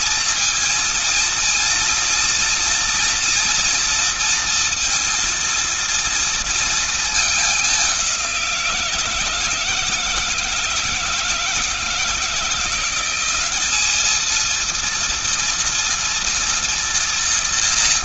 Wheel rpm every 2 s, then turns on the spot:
230, 230, 230, 230, 190, 160, 160, 220, 230.
none